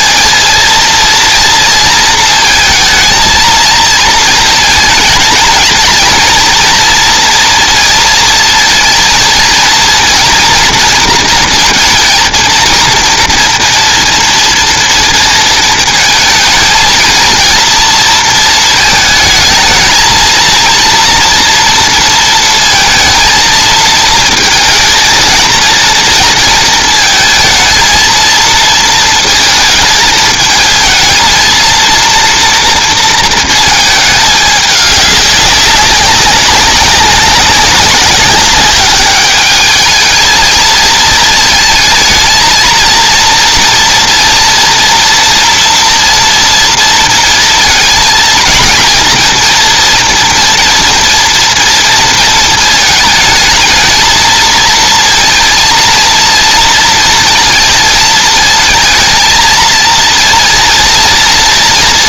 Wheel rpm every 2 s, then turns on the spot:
230, 220, 220, 230, 230, 230, 230, 230, 220, 220, 230, 230, 230, 220, 230, 220, 230, 200, 200, 200, 220, 220, 230, 230, 230, 240, 230, 230, 230, 230, 230.
none